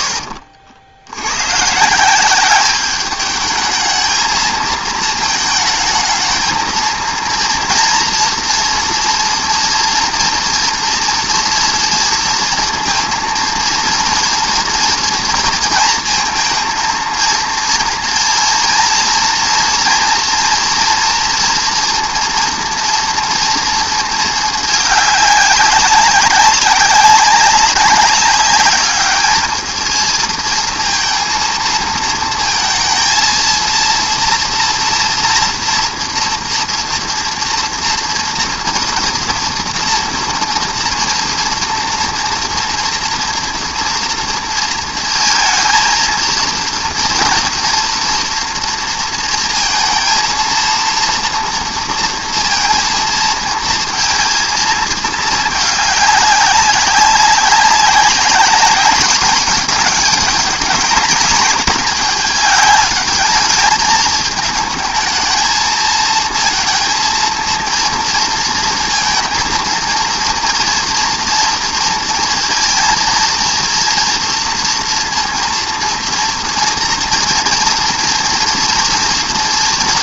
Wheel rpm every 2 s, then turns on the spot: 90, 210, 220, 230, 230, 230, 230, 230, 230, 230, 230, 230, 200, 200, 210, 230, 230, 230, 230, 240, 230, 230, 230, 230, 230, 230, 230, 220, 200, 210, 220, 210, 220, 230, 230, 240, 230, 230, 230, 230.
none